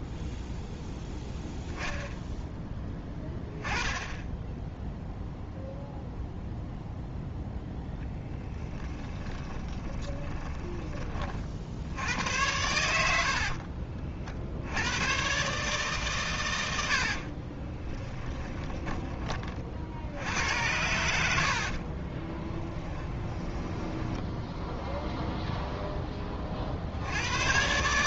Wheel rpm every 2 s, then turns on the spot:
0, 10, 0, 0, 10, 30, 90, 100, 80, 20, 100, 10, 0, 70.
8-10 12-14 16-18 22-24